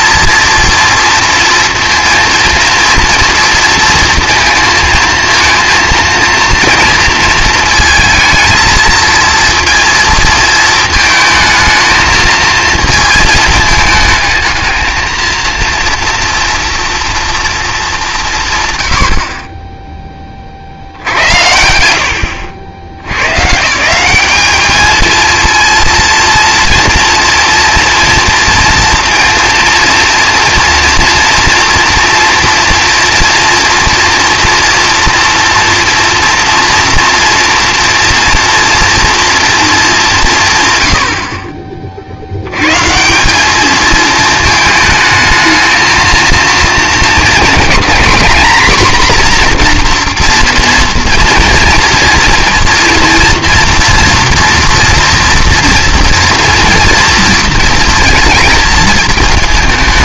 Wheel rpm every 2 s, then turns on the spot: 230, 240, 230, 230, 220, 220, 230, 220, 230, 130, 50, 70, 220, 230, 230, 230, 230, 230, 240, 240, 120, 150, 220, 220, 250, 230, 230, 230, 240, 220.
none